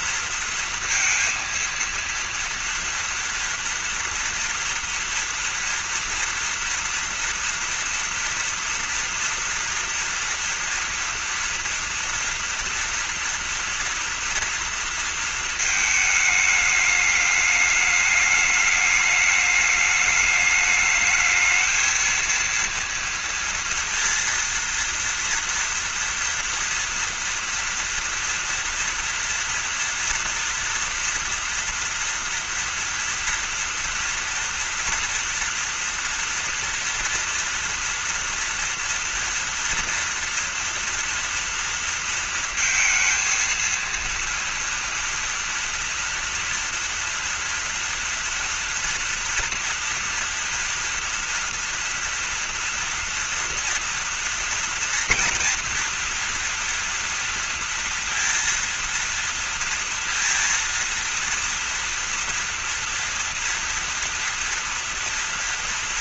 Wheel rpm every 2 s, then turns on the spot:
230, 230, 240, 230, 230, 230, 230, 230, 210, 210, 220, 230, 230, 230, 240, 230, 230, 240, 240, 230, 230, 230, 230, 230, 230, 230, 230, 230, 230, 230, 230, 230, 230.
none